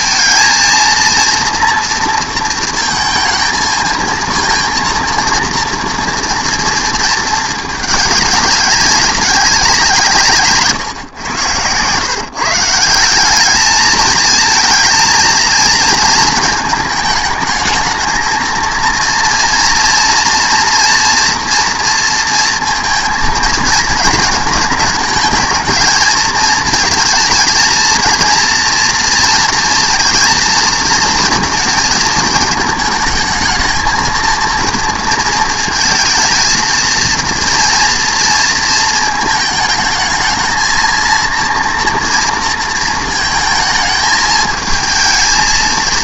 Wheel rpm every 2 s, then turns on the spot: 230, 230, 230, 230, 200, 160, 150, 230, 220, 230, 230, 230, 210, 220, 230, 230, 220, 230, 230, 230, 230, 230, 220.
none